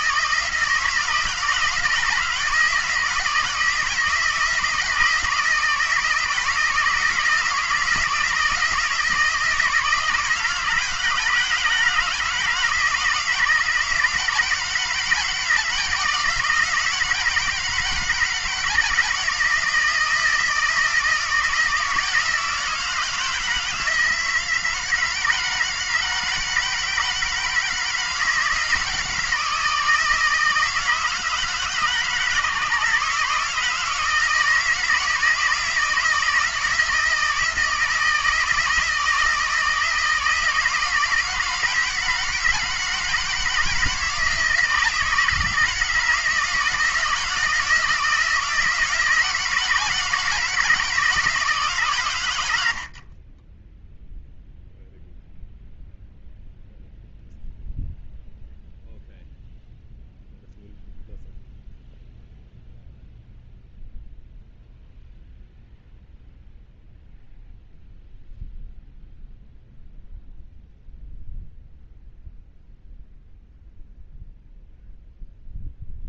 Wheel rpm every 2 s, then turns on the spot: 160, 160, 160, 160, 160, 160, 160, 160, 160, 160, 160, 160, 160, 160, 160, 160, 150, 160, 160, 160, 160, 160, 160, 160, 170, 160, 80, 0, 0, 0, 0, 0, 0, 0, 0, 0, 0, 0.
none